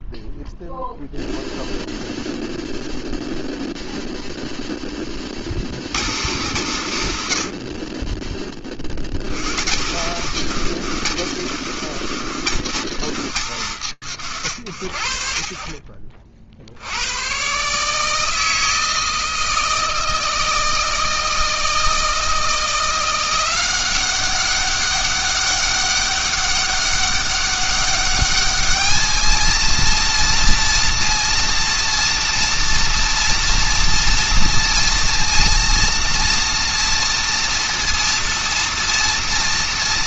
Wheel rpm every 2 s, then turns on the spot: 0, 0, 20, 160, 50, 190, 190, 110, 60, 160, 160, 170, 200, 200, 210, 230, 230, 230, 230, 230.
none